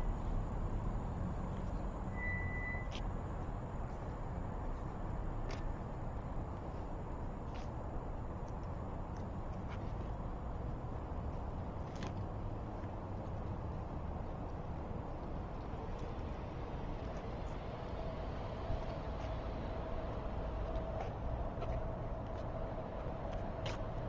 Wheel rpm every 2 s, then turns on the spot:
0, 0, 0, 0, 0, 0, 0, 0, 0, 0, 0, 0.
none